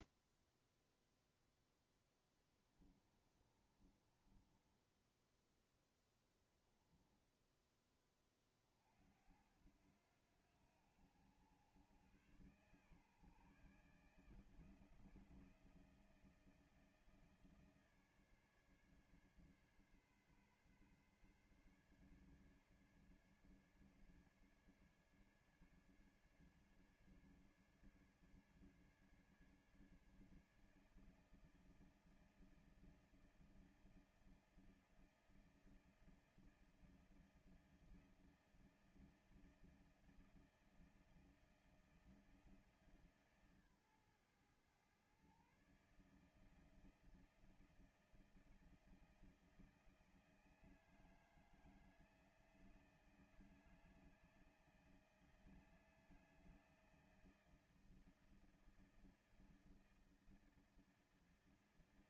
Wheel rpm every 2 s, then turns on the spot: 0, 0, 20, 10, 20, 80, 110, 150, 160, 150, 140, 150, 150, 150, 150, 150, 160, 160, 160, 160, 160, 160, 120, 150, 160, 160, 160, 160, 160, 160, 160.
4-6